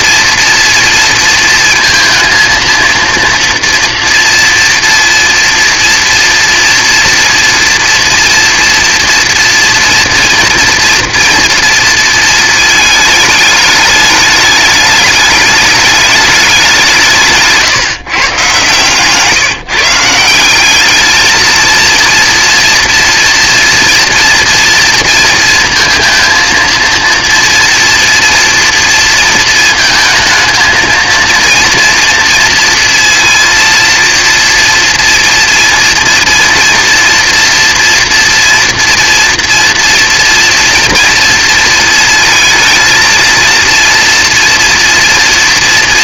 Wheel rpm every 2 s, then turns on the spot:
230, 230, 230, 230, 230, 230, 220, 210, 190, 160, 200, 230, 230, 230, 230, 220, 230, 240, 230, 230, 230, 230, 230.
none